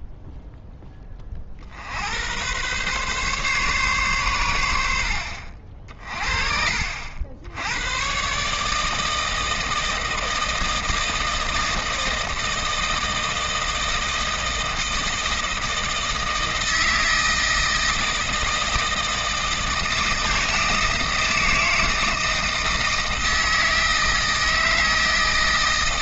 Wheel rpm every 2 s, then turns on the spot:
0, 120, 100, 50, 150, 160, 160, 160, 160, 160, 160, 160, 160.
none